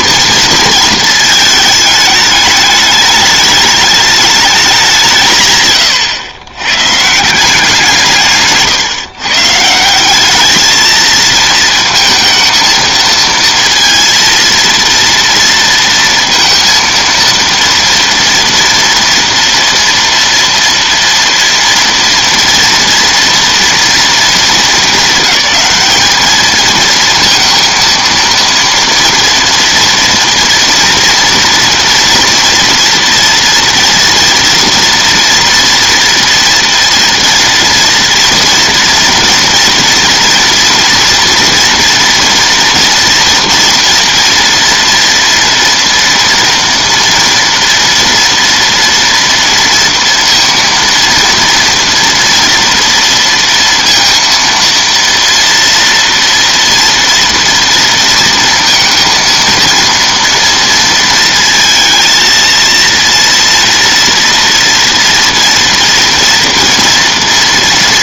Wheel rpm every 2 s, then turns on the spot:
230, 210, 180, 140, 150, 220, 230, 230, 230, 230, 230, 230, 210, 230, 230, 230, 230, 240, 230, 230, 230, 230, 230, 230, 230, 230, 230, 230, 230, 230, 230, 230, 230, 230.
none